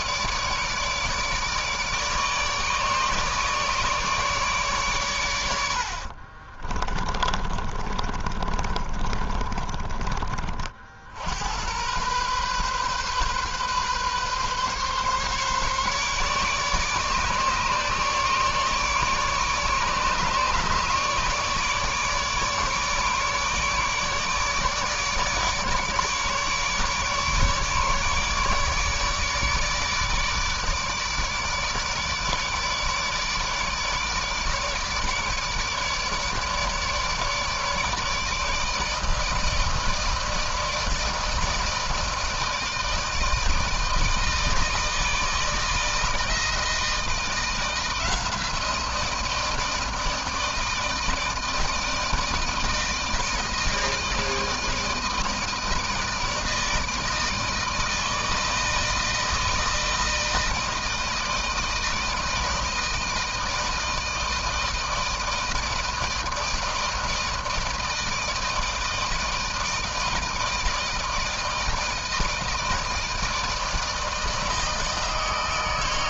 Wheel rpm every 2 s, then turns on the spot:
150, 150, 150, 50, 30, 30, 120, 130, 150, 150, 150, 150, 150, 150, 150, 150, 150, 150, 150, 150, 160, 160, 160, 160, 170, 160, 160, 160, 160, 160, 160, 160, 160, 160, 160, 160, 160, 160.
6-10